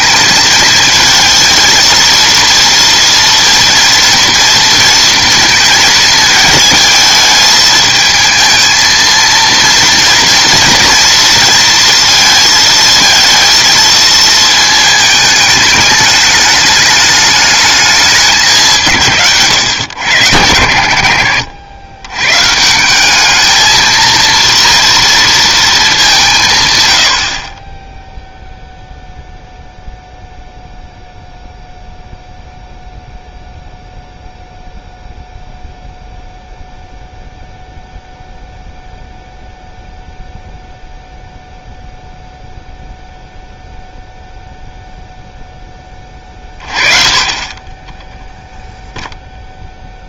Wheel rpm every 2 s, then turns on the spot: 220, 230, 230, 220, 220, 230, 230, 220, 210, 180, 90, 150, 230, 140, 0, 0, 0, 0, 0, 0, 0, 0, 0, 30, 0.
none